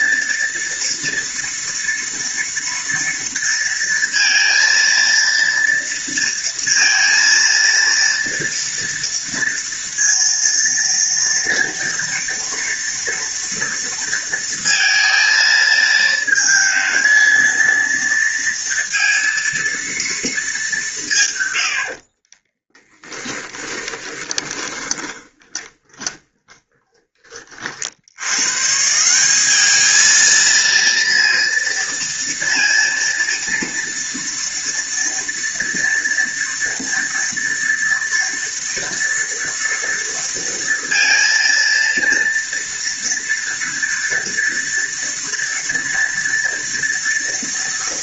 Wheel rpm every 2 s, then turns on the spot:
230, 230, 230, 230, 230, 230, 230, 230, 220, 230, 150, 10, 30, 30, 170, 230, 230, 230, 230, 230, 230, 230, 230, 230.
22-26